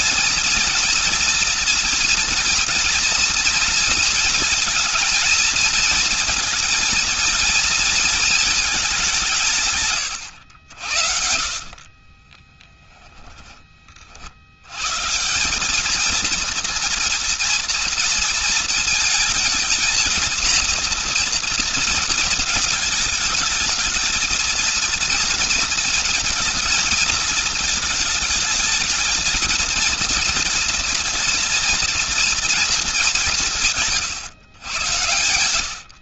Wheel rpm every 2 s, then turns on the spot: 230, 230, 230, 230, 190, 70, 10, 150, 230, 220, 230, 220, 230, 220, 220, 230, 190, 100.
10-14